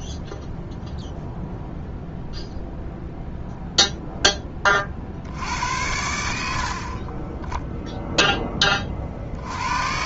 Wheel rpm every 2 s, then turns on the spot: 0, 0, 30, 60, 30.
none